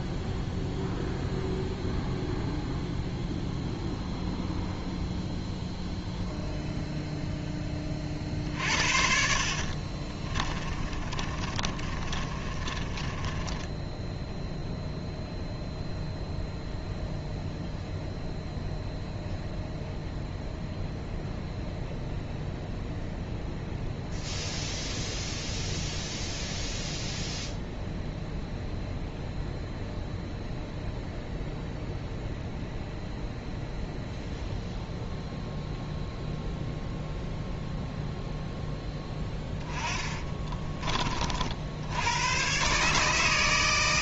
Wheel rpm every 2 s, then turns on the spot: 0, 0, 0, 0, 50, 30, 30, 0, 0, 0, 0, 0, 0, 0, 0, 0, 0, 0, 0, 0, 30, 130.
8-14